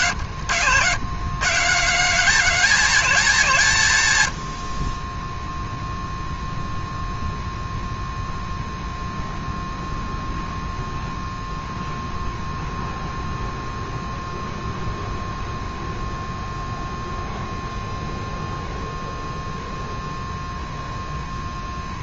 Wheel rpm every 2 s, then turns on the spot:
100, 190, 40, 0, 0, 0, 0, 0, 0, 0, 0.
none